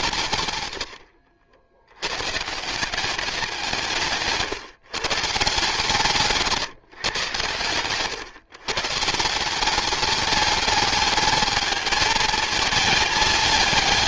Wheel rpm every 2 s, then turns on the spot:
100, 170, 150, 150, 140, 210, 220.
none